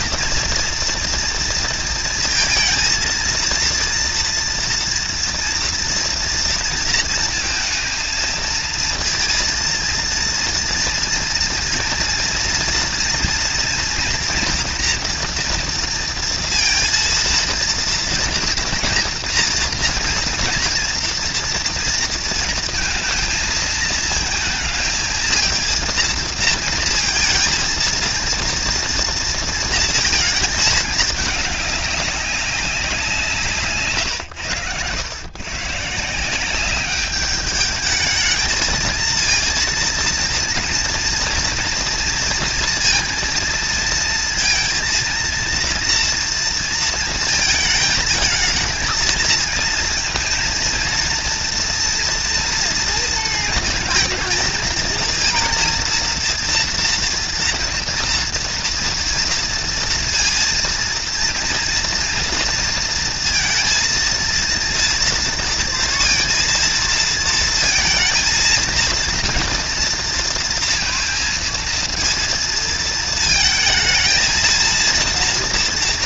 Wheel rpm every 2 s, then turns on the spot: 240, 230, 240, 230, 230, 230, 230, 240, 230, 230, 230, 230, 220, 230, 230, 220, 180, 100, 200, 220, 230, 230, 230, 230, 220, 230, 230, 230, 240, 230, 230, 230, 230, 230, 230, 230, 220, 230.
none